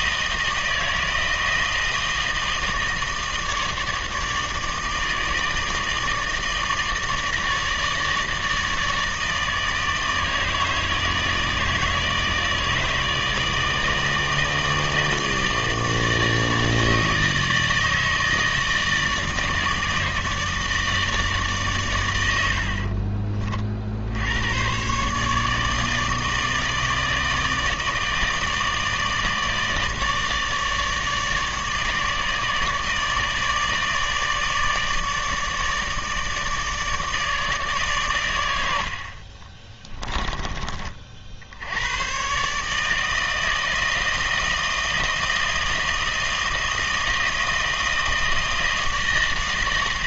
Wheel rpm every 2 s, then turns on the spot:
160, 160, 160, 160, 160, 160, 160, 160, 160, 160, 160, 60, 110, 160, 160, 150, 150, 150, 150, 70, 40, 150, 160, 160, 160.
none